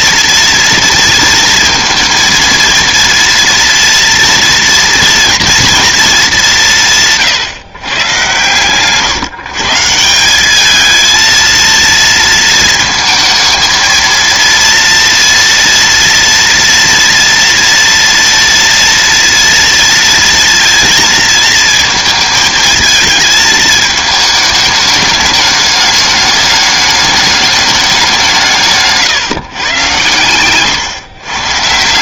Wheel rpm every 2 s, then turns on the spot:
230, 230, 230, 190, 120, 210, 230, 230, 230, 230, 230, 220, 210, 210, 160, 120.
8-10